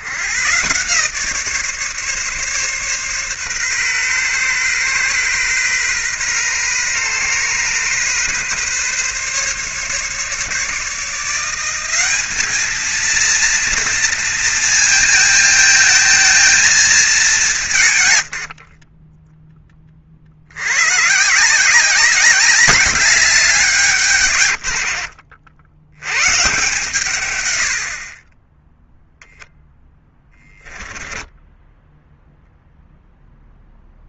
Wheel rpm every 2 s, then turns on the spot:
140, 140, 130, 130, 140, 150, 220, 230, 220, 50, 110, 200, 90, 140, 0, 10, 0.
18-20 24-26